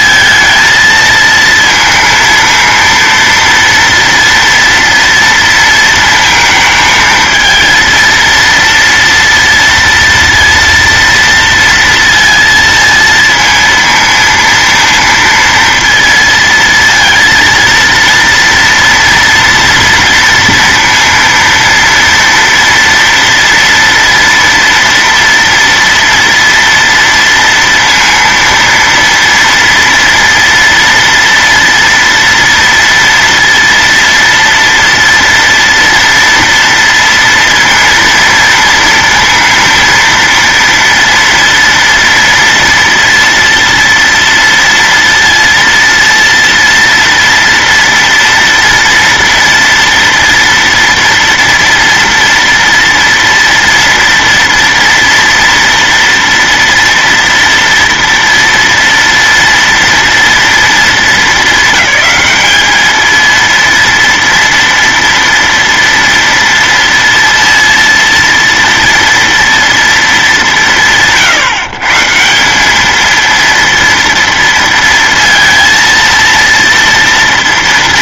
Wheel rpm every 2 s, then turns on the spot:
220, 230, 230, 220, 230, 230, 230, 230, 230, 230, 230, 230, 230, 240, 230, 240, 230, 230, 230, 230, 230, 230, 230, 230, 240, 230, 230, 230, 230, 230, 230, 220, 230, 230, 230, 150, 170, 230, 230.
none